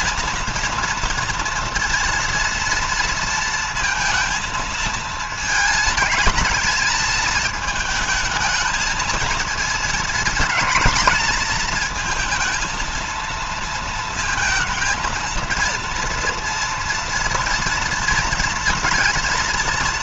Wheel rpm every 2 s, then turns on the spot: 230, 230, 220, 220, 220, 230, 230, 230, 230, 230.
none